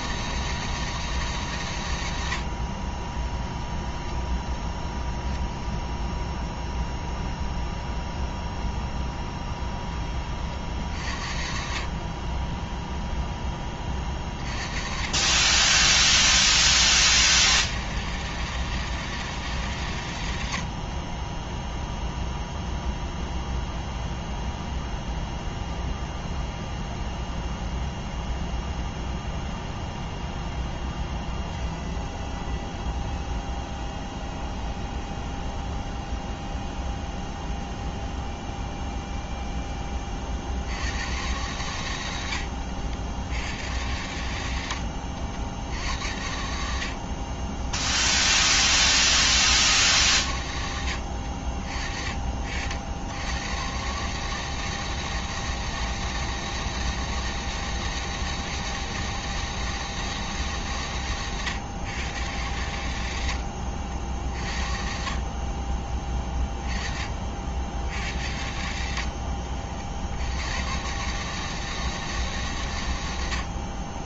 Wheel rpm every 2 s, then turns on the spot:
160, 60, 10, 0, 0, 50, 20, 40, 40, 160, 90, 0, 0, 0, 0, 0, 0, 0, 0, 0, 70, 80, 90, 60, 60, 80, 60, 160, 160, 160, 150, 100, 40, 20, 80, 90, 130.
20-22 42-46 68-70